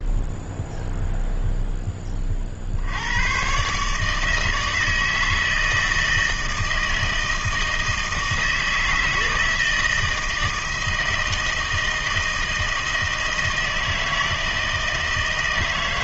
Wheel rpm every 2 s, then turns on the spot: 0, 60, 160, 160, 160, 160, 160, 160.
none